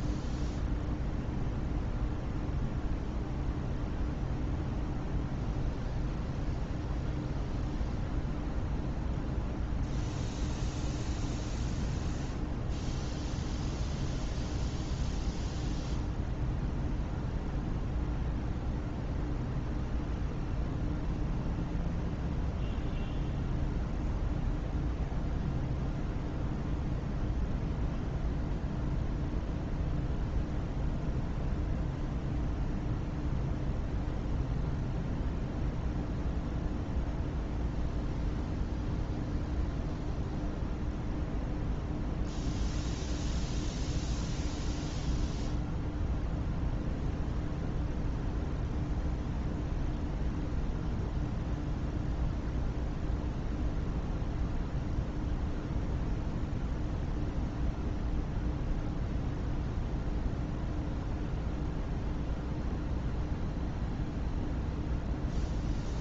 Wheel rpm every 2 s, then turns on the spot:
0, 0, 0, 0, 0, 0, 0, 0, 0, 0, 0, 0, 0, 0, 0, 0, 0, 0, 0, 0, 0, 0, 0, 0, 0, 0, 0, 0, 0, 0, 0, 0, 0.
none